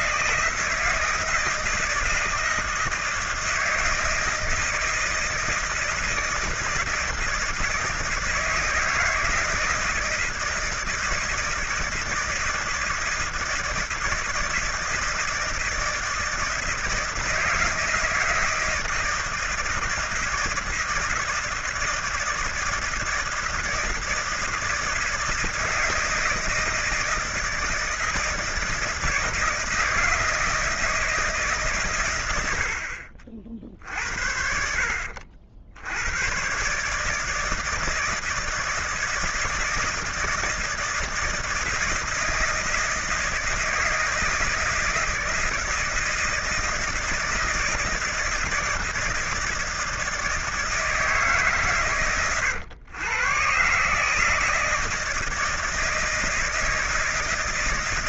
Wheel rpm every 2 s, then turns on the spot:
160, 160, 160, 160, 160, 160, 160, 160, 160, 160, 160, 160, 160, 160, 160, 160, 80, 70, 130, 160, 160, 160, 160, 170, 160, 160, 110, 160, 160.
none